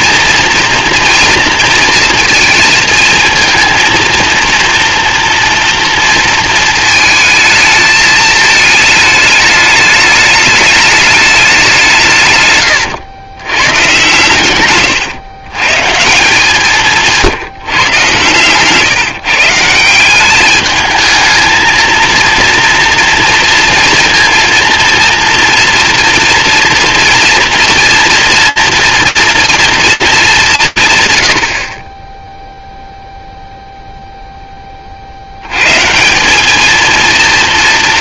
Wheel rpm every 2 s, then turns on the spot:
230, 230, 240, 220, 210, 210, 130, 110, 170, 130, 210, 240, 230, 230, 230, 160, 0, 30, 220.
14-16